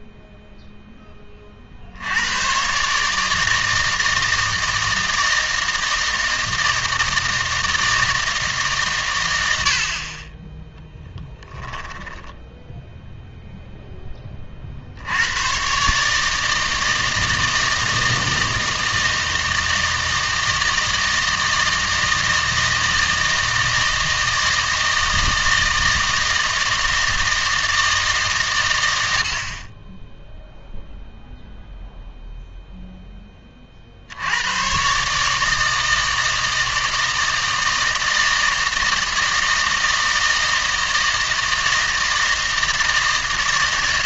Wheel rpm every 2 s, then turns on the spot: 0, 130, 160, 160, 140, 10, 10, 40, 160, 160, 160, 160, 160, 160, 120, 0, 0, 120, 160, 160, 160, 160.
12-14